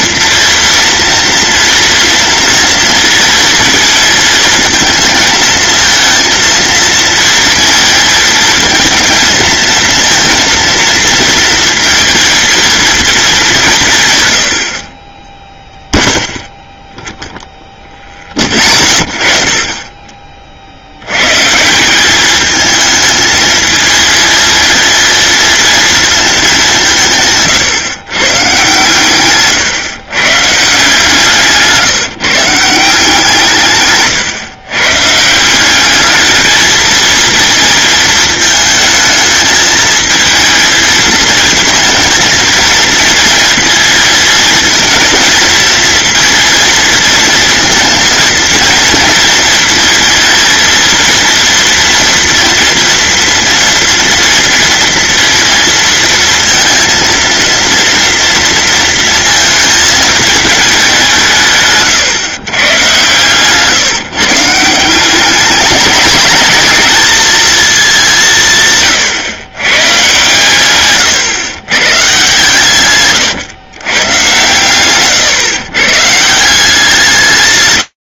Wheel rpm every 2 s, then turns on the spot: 230, 230, 220, 230, 230, 230, 230, 40, 0, 20, 90, 220, 230, 160, 140, 150, 160, 140, 220, 220, 230, 220, 220, 230, 230, 230, 240, 230, 230, 220, 180, 120, 180, 220, 130, 130, 140, 130, 160.
74-76